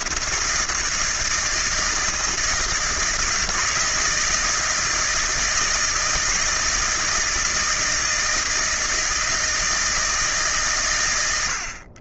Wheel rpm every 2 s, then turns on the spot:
160, 160, 170, 160, 160, 130.
none